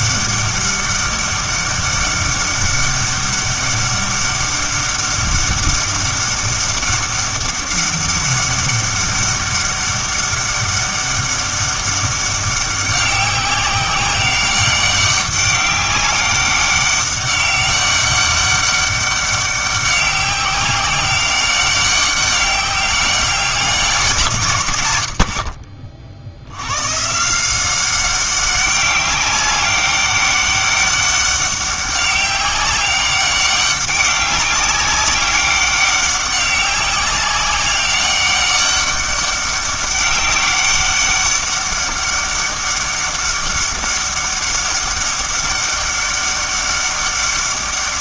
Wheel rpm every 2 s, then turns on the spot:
200, 200, 200, 200, 200, 200, 190, 200, 200, 200, 190, 200, 130, 110, 200, 200, 190, 200, 190, 200, 200, 200, 200, 200.
none